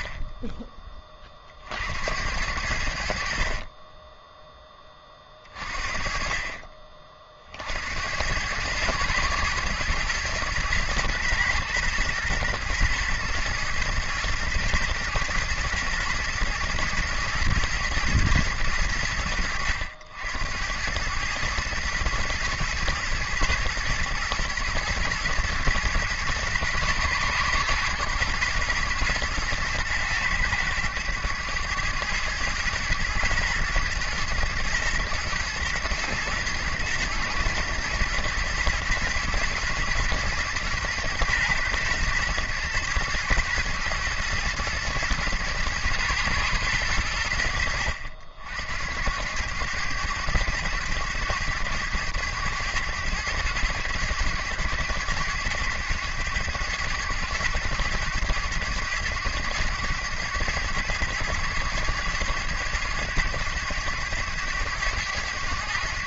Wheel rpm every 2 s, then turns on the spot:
10, 80, 10, 40, 110, 110, 120, 120, 120, 100, 90, 110, 110, 120, 120, 100, 110, 120, 120, 120, 110, 120, 110, 110, 70, 100, 100, 100, 100, 100, 110, 110, 100.
none